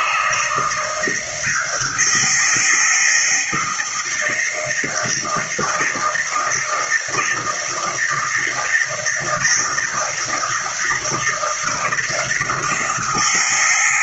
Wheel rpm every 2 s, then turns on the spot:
160, 160, 160, 160, 160, 160, 170.
none